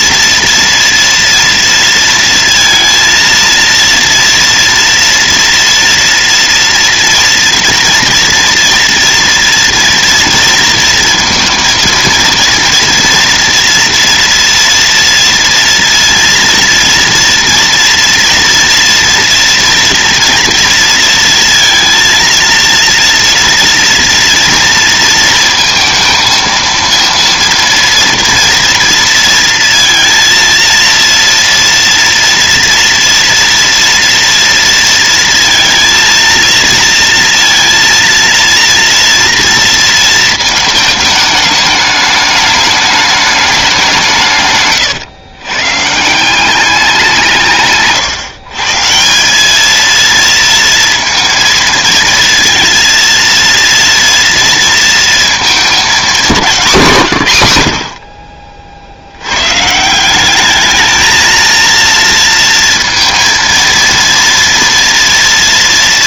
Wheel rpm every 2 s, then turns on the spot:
230, 230, 230, 240, 230, 230, 230, 230, 230, 230, 230, 230, 230, 230, 230, 230, 230, 230, 230, 230, 220, 210, 140, 190, 150, 230, 230, 230, 190, 60, 210, 230, 230.
44-46